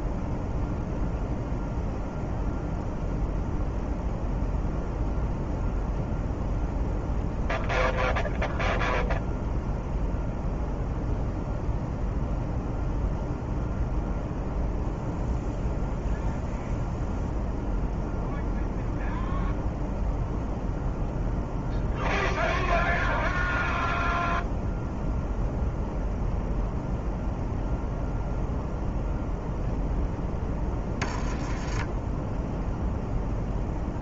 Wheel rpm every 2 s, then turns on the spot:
0, 0, 0, 0, 0, 0, 0, 0, 0, 0, 0, 0, 0, 0, 0, 10, 0.
none